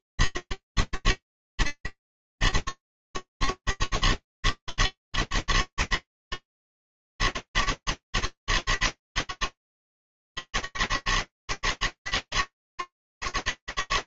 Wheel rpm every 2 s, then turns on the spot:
80, 110, 110, 110, 110, 110, 110.
none